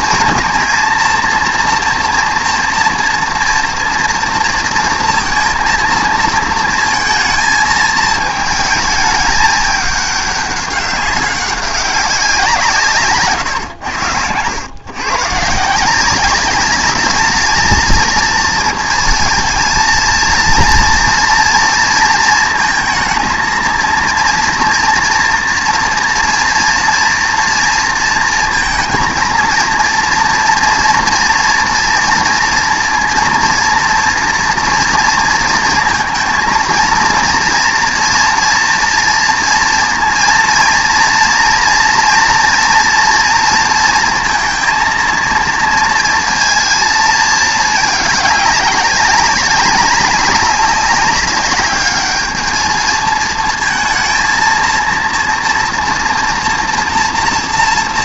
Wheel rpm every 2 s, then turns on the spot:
230, 240, 230, 230, 220, 200, 170, 110, 200, 230, 230, 230, 230, 230, 230, 240, 230, 230, 230, 230, 230, 230, 230, 230, 200, 200, 220, 230, 230.
none